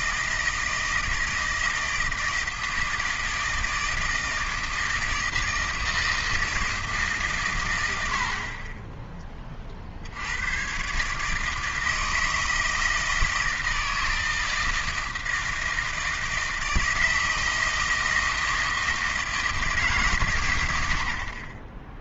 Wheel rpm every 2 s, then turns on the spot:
160, 160, 160, 160, 30, 120, 160, 160, 160, 160, 90.
none